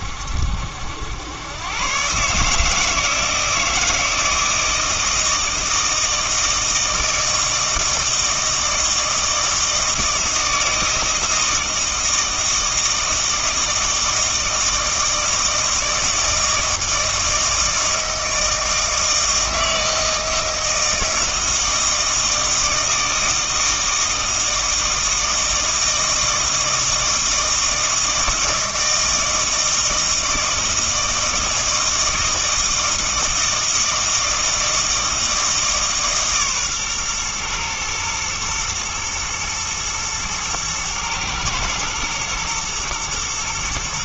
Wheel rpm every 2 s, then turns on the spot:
80, 150, 160, 160, 160, 160, 160, 160, 160, 160, 160, 160, 160, 160, 160, 160, 160, 160, 130, 120, 110, 120.
none